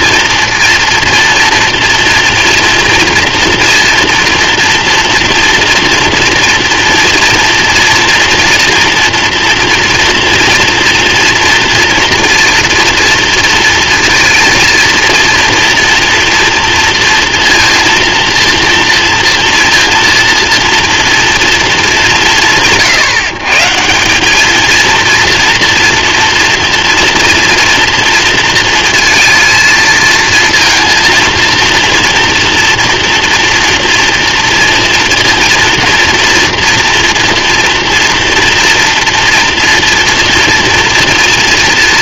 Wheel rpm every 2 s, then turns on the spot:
230, 230, 230, 230, 230, 230, 230, 230, 230, 230, 230, 120, 220, 230, 230, 230, 240, 230, 240, 230, 230.
none